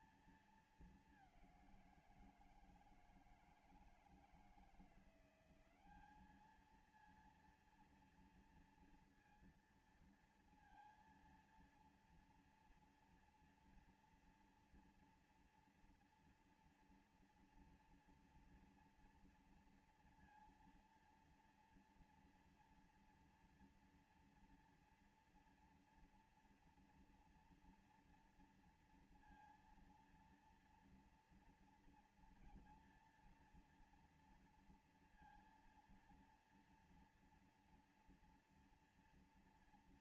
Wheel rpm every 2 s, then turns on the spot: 220, 170, 170, 220, 230, 230, 230, 230, 230, 230, 230, 230, 230, 230, 230, 230, 230, 230, 230, 230.
none